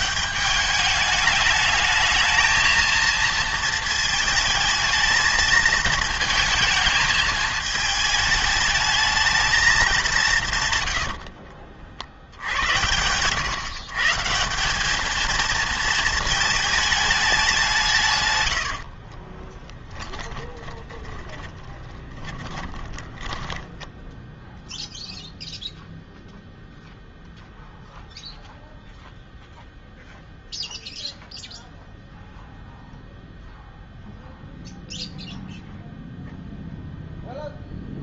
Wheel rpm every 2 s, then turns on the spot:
200, 230, 220, 220, 210, 130, 90, 190, 220, 80, 20, 20, 0, 0, 0, 0, 0, 0, 0.
18-24